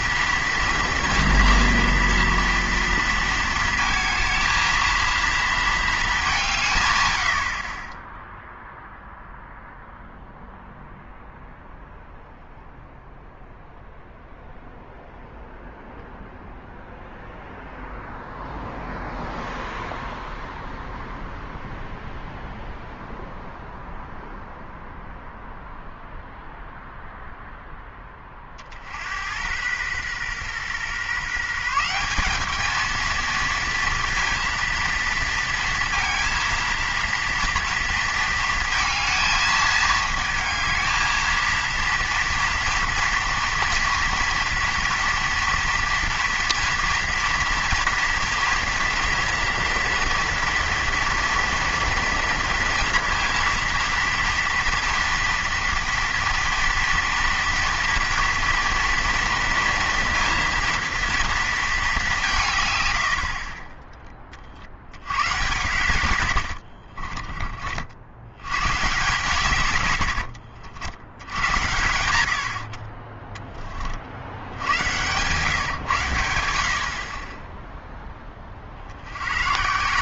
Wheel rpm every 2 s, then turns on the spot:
230, 230, 220, 160, 0, 0, 0, 0, 0, 0, 0, 0, 0, 0, 40, 130, 210, 230, 230, 230, 220, 230, 230, 230, 230, 230, 230, 230, 230, 230, 230, 130, 60, 60, 120, 70, 60, 90, 70, 50.
66-68